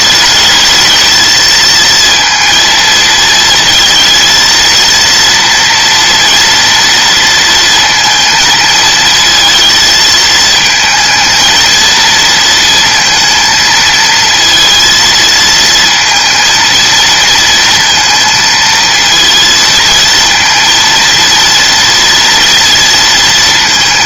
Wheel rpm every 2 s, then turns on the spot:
220, 230, 230, 230, 220, 220, 230, 230, 230, 230, 230, 230.
none